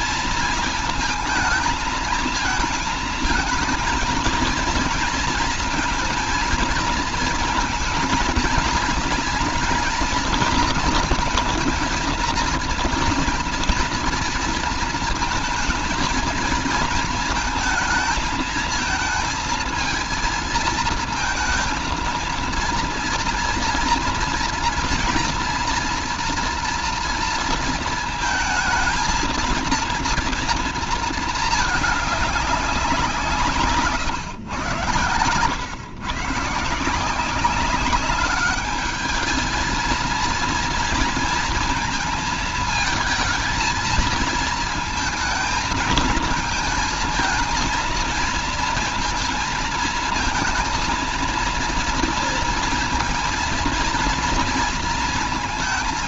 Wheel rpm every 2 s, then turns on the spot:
220, 220, 230, 230, 230, 230, 240, 230, 220, 220, 220, 230, 230, 230, 220, 220, 170, 110, 170, 210, 230, 220, 220, 230, 230, 230, 230, 220.
none